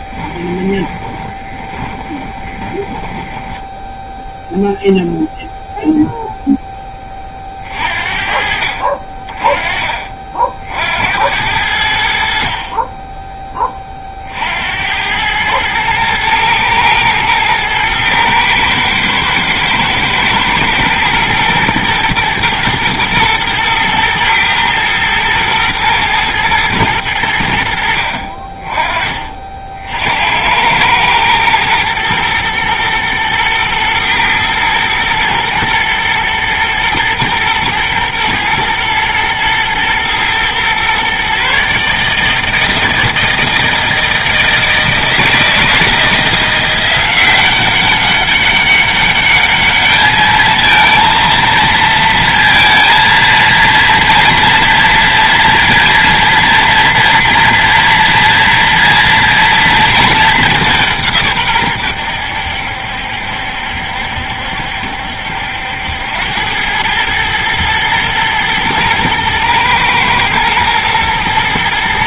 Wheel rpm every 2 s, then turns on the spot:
10, 10, 0, 20, 40, 70, 10, 90, 110, 110, 120, 110, 120, 110, 40, 110, 120, 120, 120, 110, 130, 160, 160, 180, 200, 230, 230, 230, 240, 230, 160, 70, 70, 110, 120, 110.
0-4